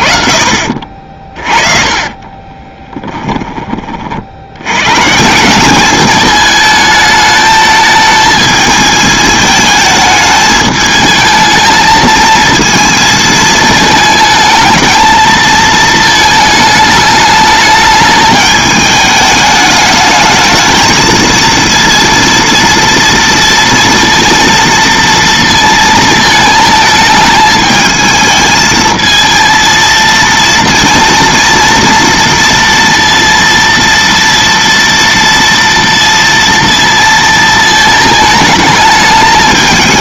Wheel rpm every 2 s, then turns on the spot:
40, 20, 100, 210, 220, 210, 220, 220, 220, 210, 220, 230, 230, 220, 220, 230, 230, 230, 230, 220.
2-4